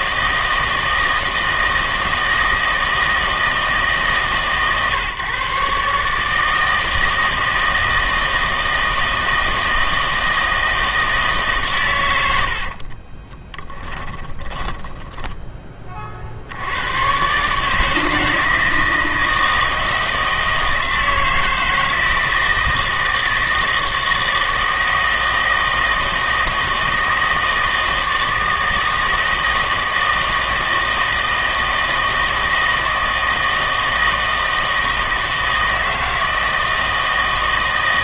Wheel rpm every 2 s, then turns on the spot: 160, 160, 140, 160, 160, 160, 50, 10, 100, 160, 160, 160, 160, 160, 160, 160, 160, 160, 160.
12-16